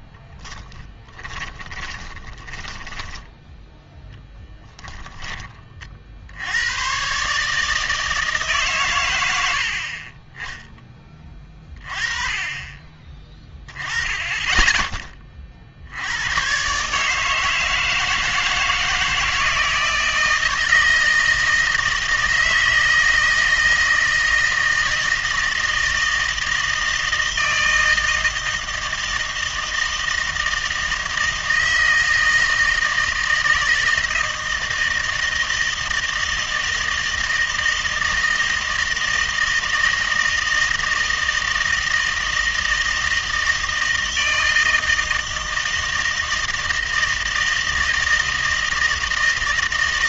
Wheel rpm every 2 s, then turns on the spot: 10, 10, 10, 90, 150, 10, 30, 20, 120, 160, 160, 160, 160, 160, 160, 160, 160, 160, 160, 160, 160, 160, 160, 160, 160.
0-2 4-6